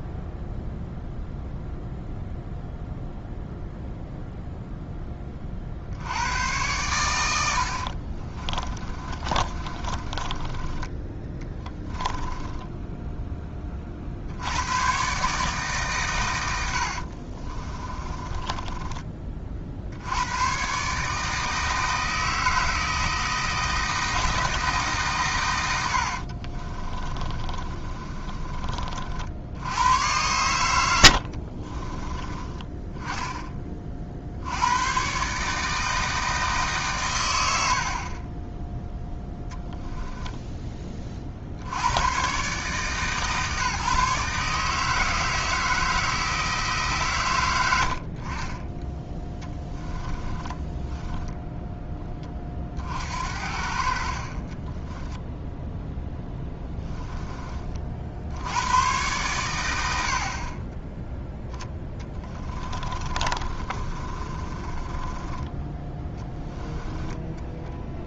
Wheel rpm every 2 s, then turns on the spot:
0, 0, 10, 100, 20, 20, 10, 110, 70, 20, 140, 160, 140, 30, 40, 90, 20, 110, 140, 10, 20, 150, 160, 150, 20, 10, 50, 20, 10, 100, 20, 20, 30, 10.
8-10 12-14 16-20 26-28 50-52 54-56 62-68